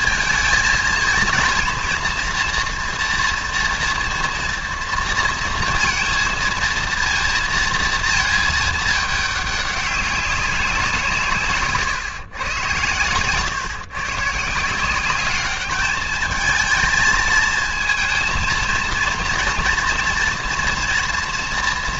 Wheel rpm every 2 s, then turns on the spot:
230, 230, 230, 230, 220, 190, 110, 160, 220, 230, 230.
none